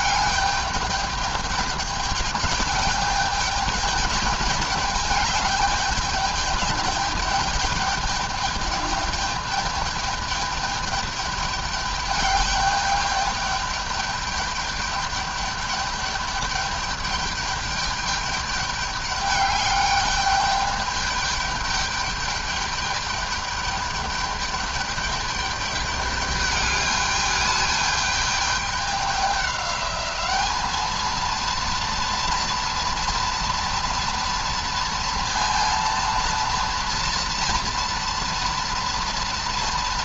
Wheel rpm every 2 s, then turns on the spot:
210, 210, 210, 210, 210, 210, 210, 210, 210, 200, 200, 210, 210, 210, 210, 210, 230, 230, 230, 230.
none